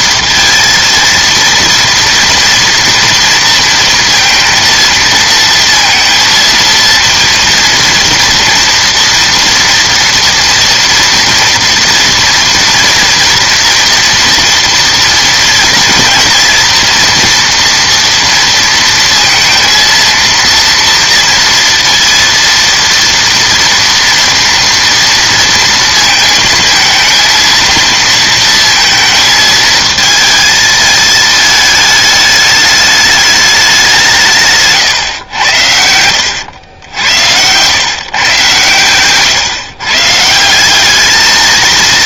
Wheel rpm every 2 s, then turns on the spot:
230, 230, 230, 230, 230, 230, 230, 230, 230, 230, 230, 230, 230, 220, 230, 220, 210, 140, 90, 120, 190.
none